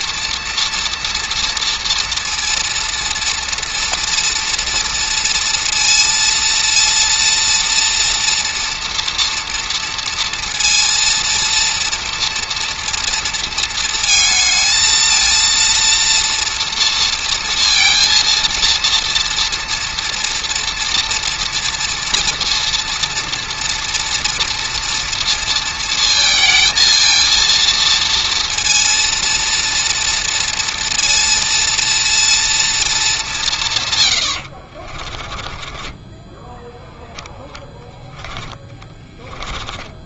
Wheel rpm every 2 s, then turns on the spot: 230, 230, 230, 230, 230, 230, 230, 220, 230, 230, 230, 230, 230, 230, 230, 230, 220, 50, 10, 20.
34-40